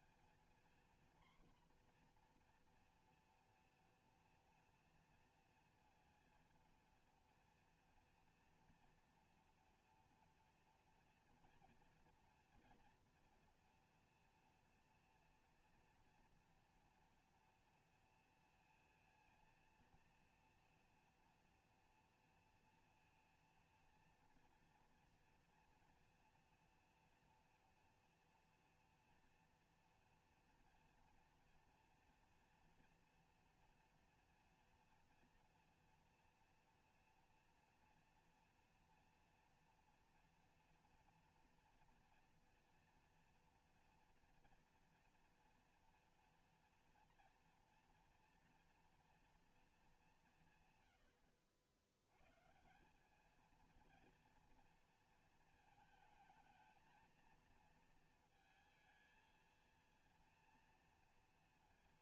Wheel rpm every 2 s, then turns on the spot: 230, 240, 230, 230, 230, 230, 230, 230, 230, 230, 230, 230, 230, 230, 230, 230, 240, 230, 240, 230, 240, 230, 230, 230, 230, 160, 140, 230, 230, 220, 230.
none